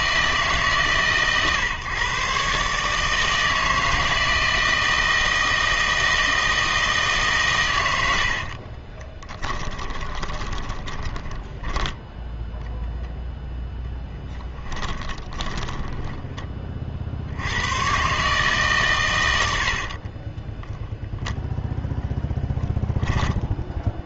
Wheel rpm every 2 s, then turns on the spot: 150, 140, 160, 160, 40, 20, 0, 10, 30, 150, 20, 0.
8-12 14-16 20-22